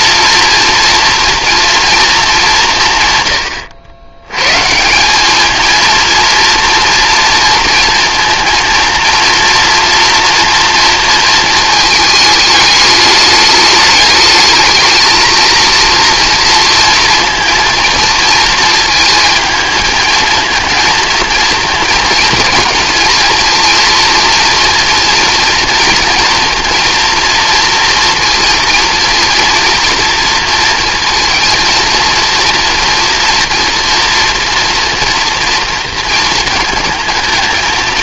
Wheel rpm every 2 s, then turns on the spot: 230, 150, 160, 230, 230, 230, 210, 220, 230, 230, 230, 230, 230, 230, 230, 230, 230, 230, 230.
none